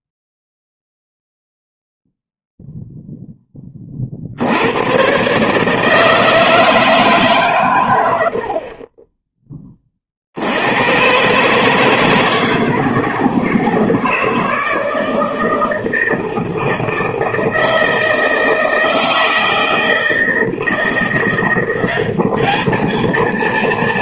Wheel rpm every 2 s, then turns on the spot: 0, 0, 90, 160, 50, 80, 160, 160, 160, 160, 160, 210.
none